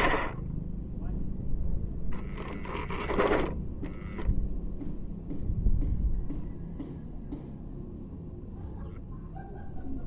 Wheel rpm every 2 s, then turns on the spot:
0, 10, 0, 0, 0.
none